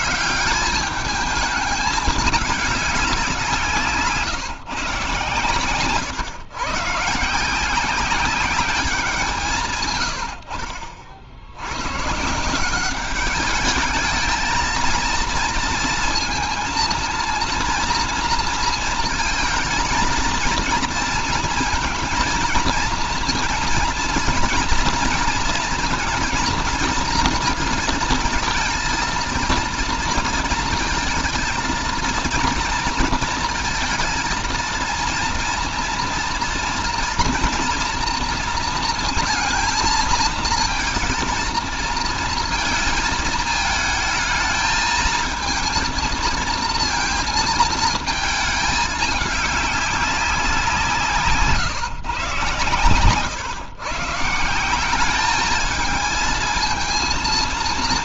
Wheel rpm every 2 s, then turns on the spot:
170, 200, 140, 110, 190, 70, 170, 220, 230, 230, 220, 230, 230, 230, 230, 230, 230, 230, 240, 230, 220, 230, 220, 230, 220, 180, 130, 170, 230.
none